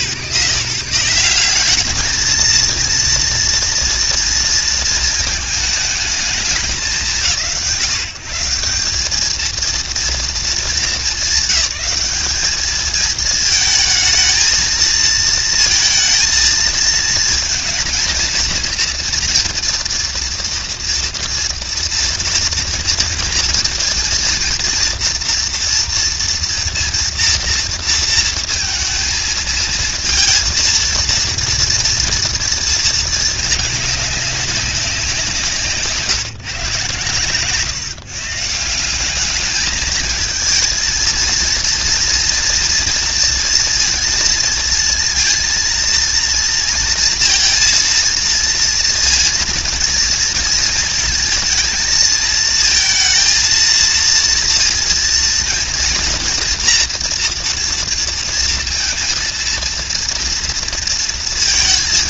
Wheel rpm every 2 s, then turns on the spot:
150, 230, 220, 160, 190, 210, 210, 230, 220, 230, 230, 230, 230, 230, 230, 230, 220, 180, 130, 190, 230, 230, 230, 230, 230, 230, 230, 230, 240, 230, 230.
none